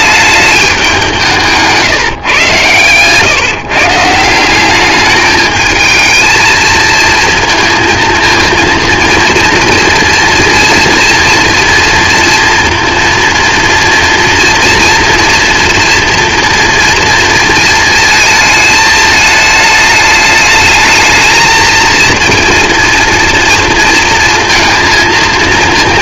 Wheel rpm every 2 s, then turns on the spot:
200, 120, 190, 220, 230, 230, 230, 230, 230, 220, 220, 230, 230.
none